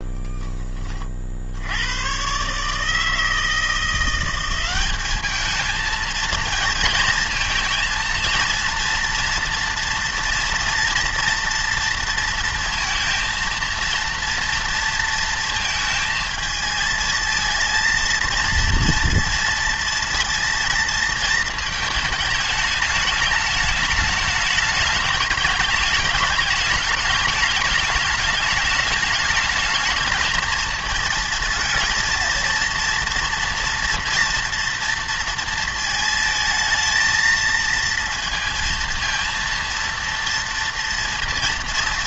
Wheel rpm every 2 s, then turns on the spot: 20, 140, 190, 230, 230, 230, 230, 230, 220, 230, 230, 220, 210, 210, 210, 220, 230, 230, 220, 230, 230.
none